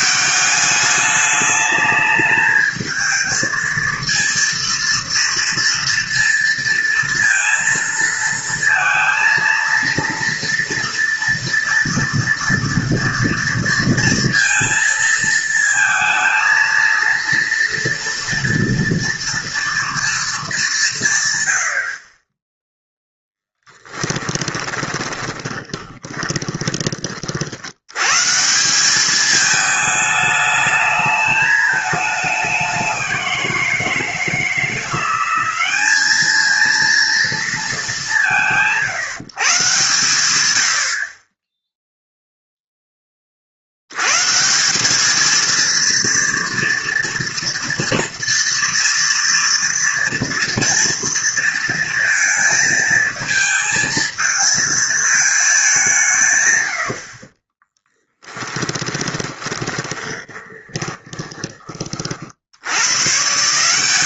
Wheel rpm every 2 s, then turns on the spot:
200, 220, 230, 230, 230, 230, 230, 230, 230, 230, 200, 10, 20, 20, 170, 210, 190, 170, 220, 170, 100, 0, 170, 230, 230, 230, 220, 230, 100, 20, 20, 100.
24-26 58-62